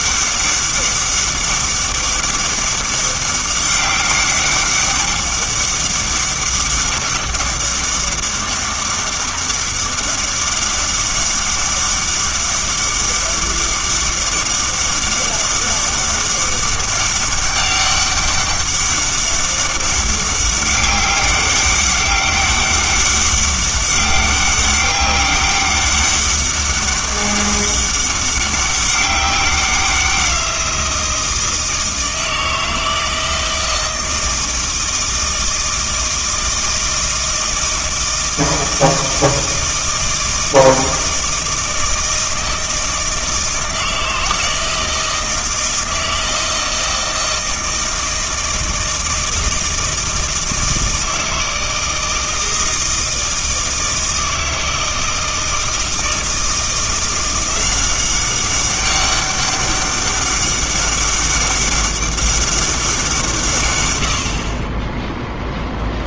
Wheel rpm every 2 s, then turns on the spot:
200, 200, 200, 200, 200, 200, 200, 200, 200, 200, 200, 200, 200, 200, 200, 170, 160, 160, 160, 160, 160, 160, 160, 160, 160, 160, 160, 160, 170, 200, 200, 190, 20.
none